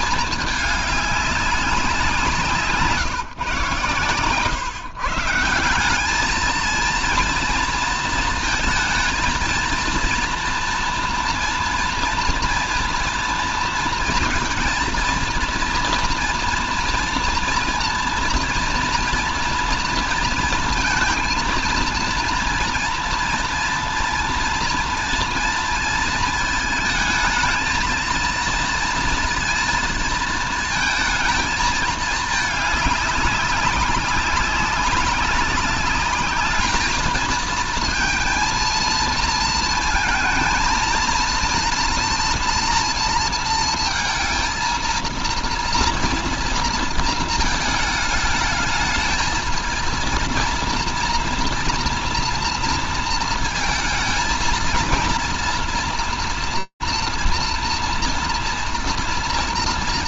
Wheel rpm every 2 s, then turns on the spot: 210, 160, 140, 230, 220, 230, 230, 230, 230, 230, 230, 240, 240, 220, 230, 230, 210, 190, 220, 230, 230, 230, 230, 230, 220, 230, 230, 230, 230, 230.
none